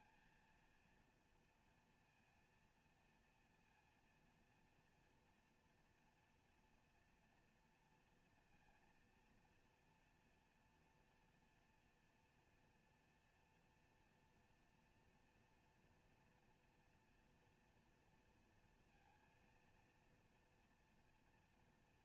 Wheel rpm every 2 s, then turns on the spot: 240, 230, 230, 230, 230, 230, 230, 230, 230, 230, 230.
none